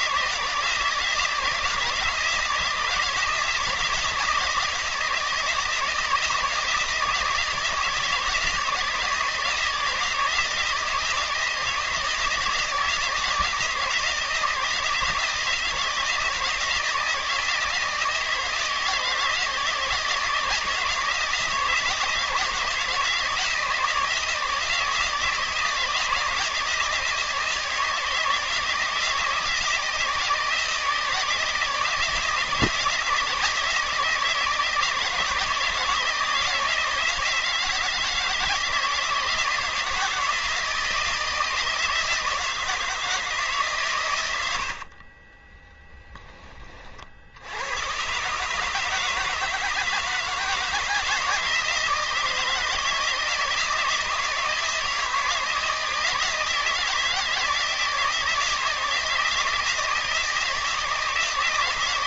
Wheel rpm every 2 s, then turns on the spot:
160, 160, 160, 160, 160, 160, 170, 160, 160, 160, 170, 160, 160, 160, 160, 160, 160, 160, 160, 170, 160, 160, 40, 50, 150, 170, 160, 160, 160, 160, 160.
44-46